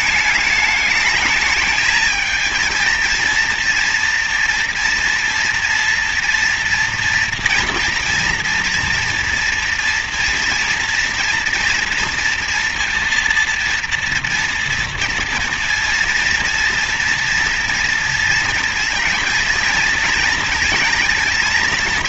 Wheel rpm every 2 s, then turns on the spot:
210, 230, 230, 230, 230, 230, 230, 240, 230, 230, 230.
none